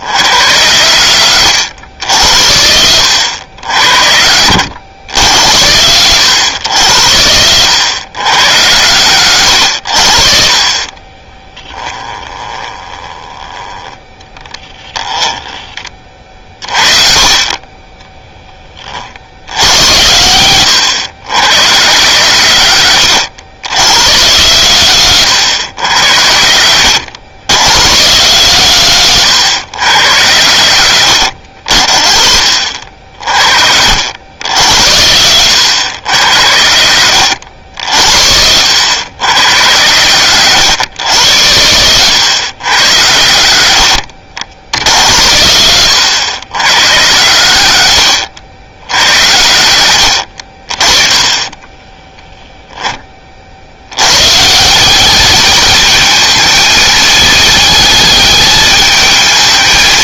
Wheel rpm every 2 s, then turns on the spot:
50, 40, 50, 50, 50, 10, 10, 10, 40, 10, 60, 60, 60, 50, 70, 60, 40, 50, 50, 50, 80, 90, 50, 90, 60, 30, 10, 180, 220, 210.
14-16 52-54